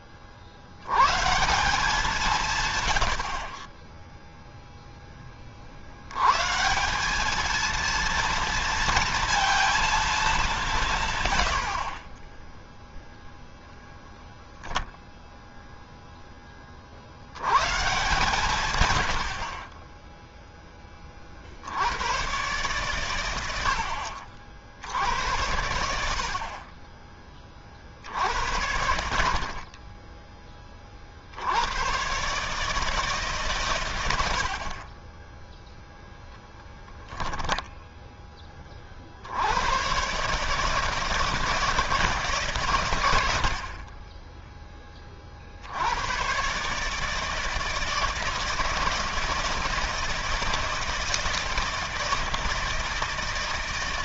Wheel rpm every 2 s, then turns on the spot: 110, 110, 10, 180, 230, 130, 0, 0, 50, 100, 20, 130, 60, 40, 70, 30, 150, 50, 10, 40, 150, 90, 20, 150, 160, 160, 160.
none